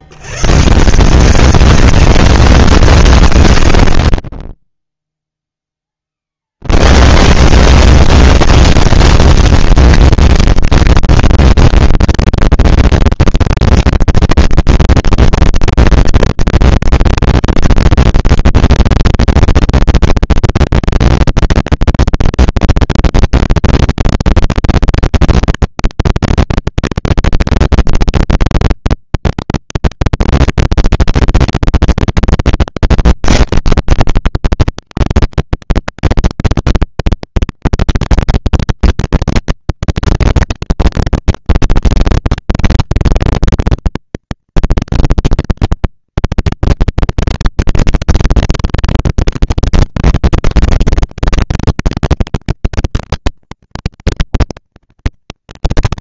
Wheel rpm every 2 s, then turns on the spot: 120, 230, 30, 60, 230, 230, 230, 230, 230, 230, 240, 230, 230, 230, 230, 220, 230, 200, 190, 220, 230, 230, 230, 230, 230, 240, 230, 230.
none